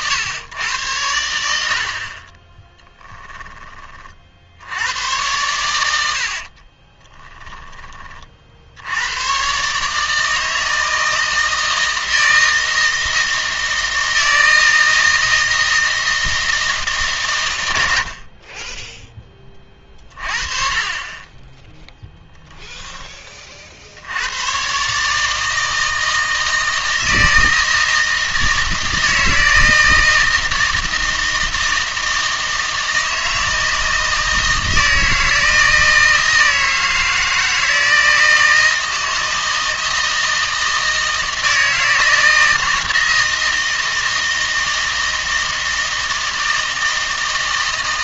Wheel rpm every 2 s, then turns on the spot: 110, 10, 90, 30, 80, 160, 160, 160, 160, 20, 30, 10, 130, 160, 160, 160, 160, 160, 160, 160, 160, 160, 160, 160.
2-4 6-8